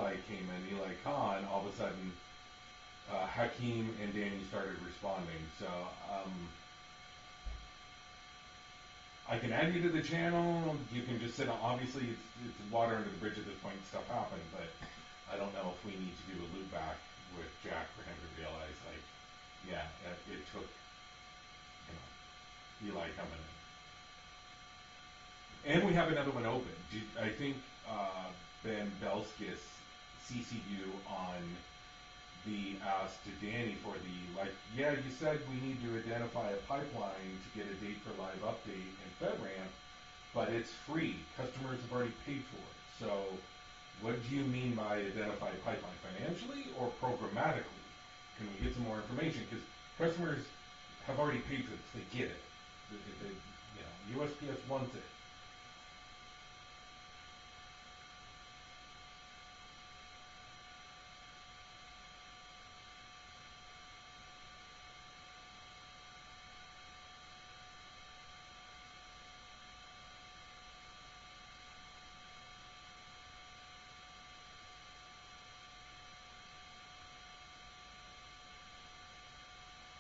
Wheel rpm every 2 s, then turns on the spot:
0, 0, 0, 0, 0, 0, 0, 0, 0, 0, 0, 0, 0, 0, 0, 0, 0, 0, 0, 0, 0, 0, 0, 0, 0, 0, 0, 0, 0, 0, 0, 0, 0, 0, 0, 0, 0, 0, 0, 0.
none